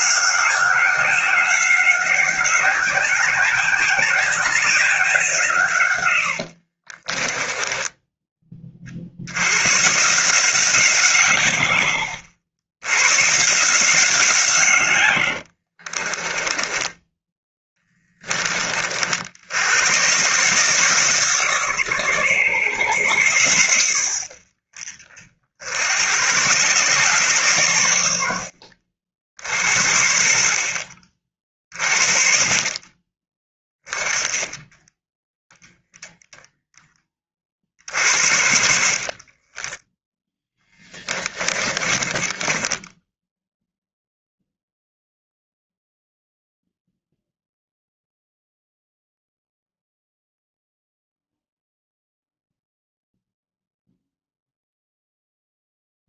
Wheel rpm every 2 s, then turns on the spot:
180, 190, 180, 40, 60, 160, 110, 110, 10, 60, 150, 120, 60, 120, 60, 50, 30, 10, 30, 40, 20, 10, 0, 0, 0, 0, 0, 0.
6-8 16-18 40-44